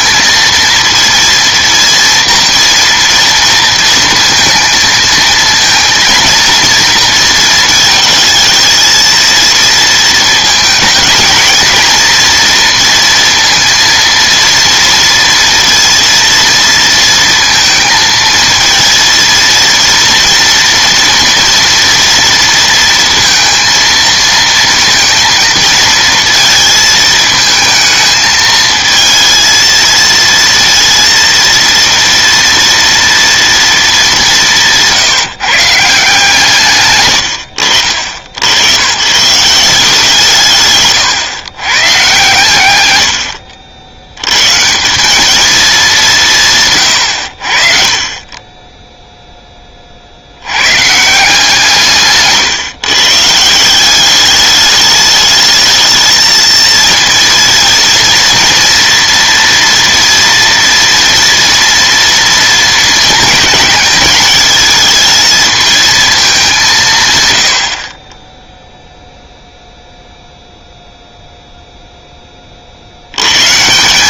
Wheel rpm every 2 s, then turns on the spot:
230, 230, 230, 230, 220, 220, 230, 230, 230, 220, 230, 230, 230, 220, 220, 230, 230, 160, 140, 110, 140, 110, 160, 140, 10, 120, 140, 210, 230, 230, 230, 220, 220, 170, 0, 0, 40.
34-36 40-42